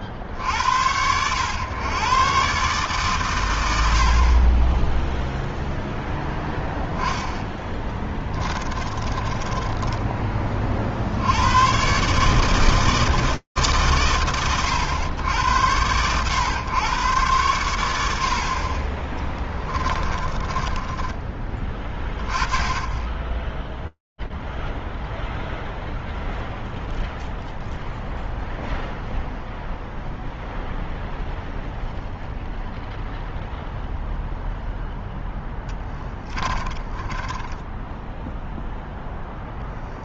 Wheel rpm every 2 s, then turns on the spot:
80, 140, 40, 0, 20, 30, 150, 80, 120, 30, 20, 20, 0, 0, 0, 0, 0, 0, 20, 0.
8-10 20-22 36-38